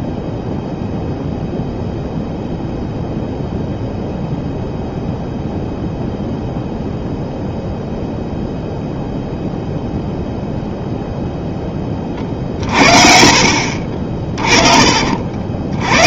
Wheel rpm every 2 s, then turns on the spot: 0, 0, 0, 0, 0, 0, 50, 30.
12-16